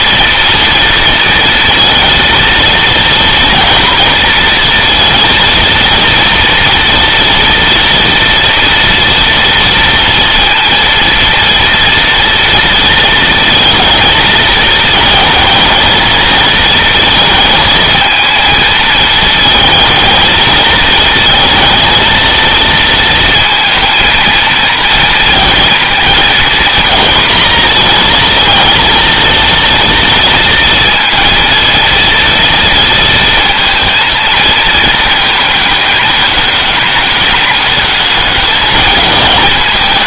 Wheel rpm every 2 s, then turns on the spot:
230, 240, 230, 230, 230, 230, 230, 220, 220, 220, 220, 230, 230, 230, 230, 230, 230, 220, 210, 220.
none